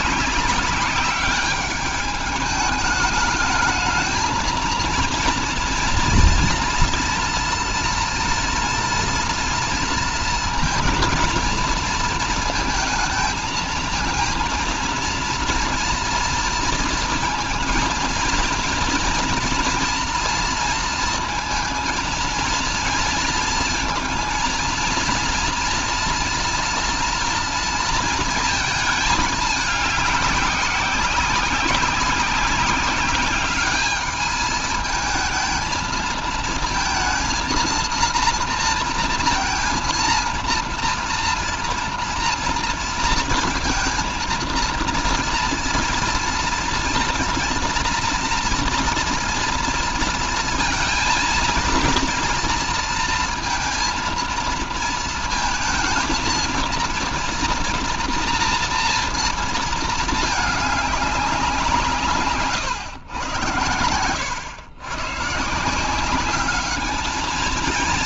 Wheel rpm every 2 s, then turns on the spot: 200, 210, 220, 240, 230, 230, 230, 230, 230, 230, 230, 230, 230, 230, 220, 190, 190, 220, 220, 230, 230, 230, 230, 230, 230, 230, 230, 230, 230, 230, 210, 120, 100, 210.
none